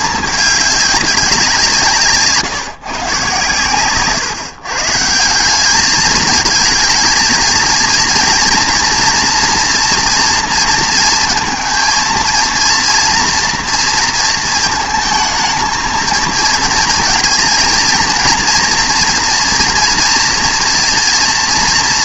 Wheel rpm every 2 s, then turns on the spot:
210, 150, 150, 220, 230, 230, 230, 230, 230, 240, 230.
none